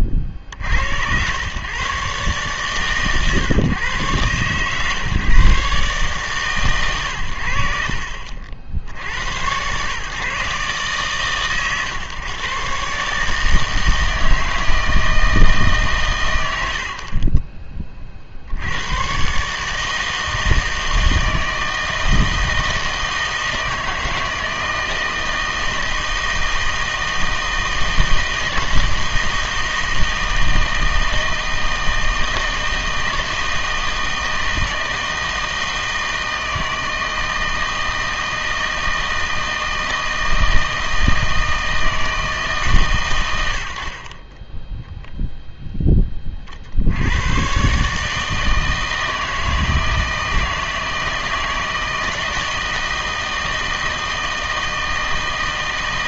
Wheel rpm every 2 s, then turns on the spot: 60, 130, 140, 130, 70, 140, 140, 160, 70, 90, 160, 160, 160, 160, 160, 160, 160, 160, 160, 160, 160, 140, 10, 50, 160, 160, 160, 160.
44-46